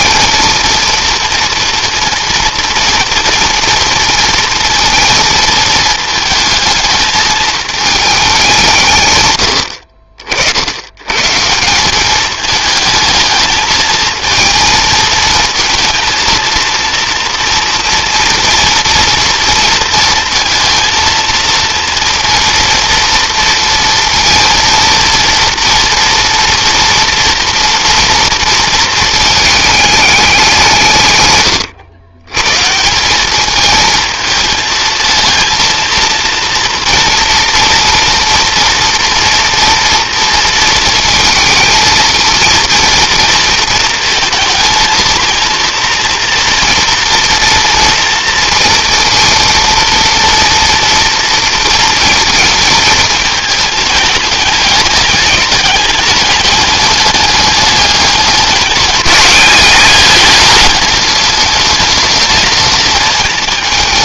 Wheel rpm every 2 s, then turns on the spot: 230, 230, 230, 220, 150, 110, 220, 220, 230, 230, 230, 230, 230, 230, 220, 150, 170, 220, 230, 230, 230, 230, 220, 230, 230, 230, 220, 200, 210, 200, 210, 220.
none